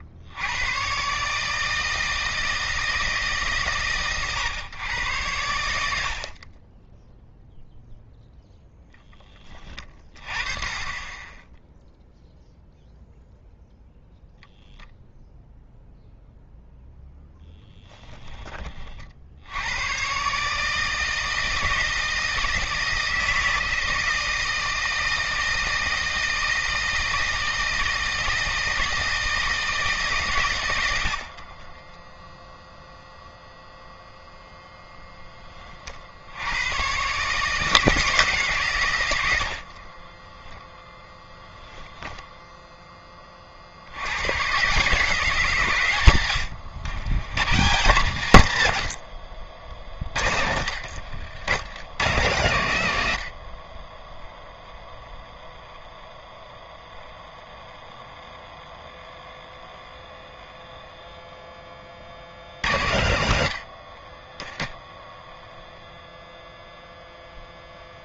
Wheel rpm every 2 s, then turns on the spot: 70, 160, 120, 40, 0, 20, 0, 0, 0, 20, 140, 160, 160, 160, 160, 120, 0, 0, 100, 140, 10, 10, 130, 90, 140, 60, 110, 0, 0, 0, 0, 80, 10, 0.
6-8 50-52